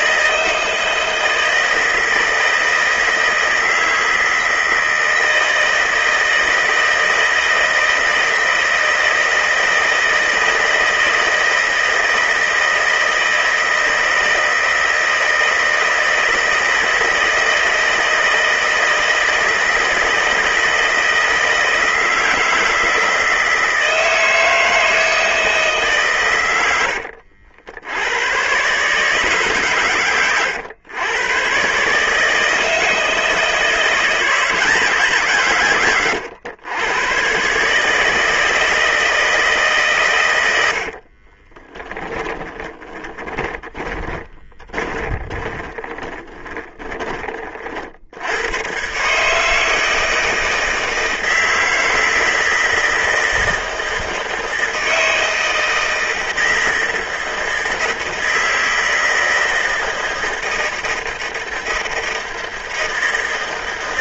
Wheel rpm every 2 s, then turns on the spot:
160, 160, 160, 160, 160, 160, 160, 160, 160, 160, 160, 160, 160, 100, 130, 110, 160, 160, 110, 160, 70, 20, 10, 20, 110, 160, 160, 160, 160, 160, 160, 160.
42-48